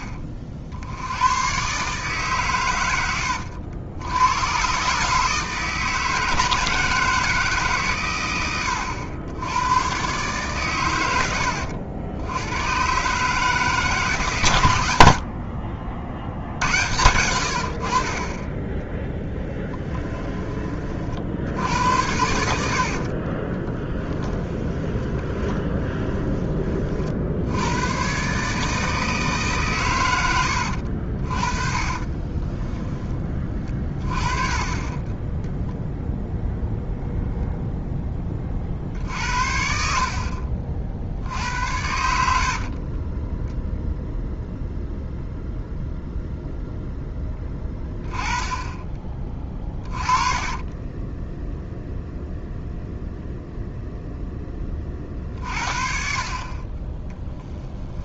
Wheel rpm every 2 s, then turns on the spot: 60, 90, 140, 160, 100, 110, 130, 90, 90, 10, 40, 50, 20, 40, 160, 70, 10, 20, 0, 60, 60, 40, 0, 10, 20, 20, 0, 30, 20.
22-26 30-32 34-36 50-52